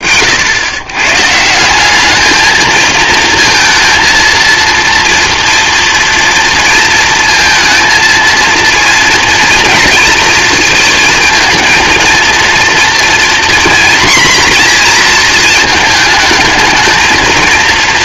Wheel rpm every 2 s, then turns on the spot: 120, 220, 230, 230, 230, 230, 240, 230, 220.
none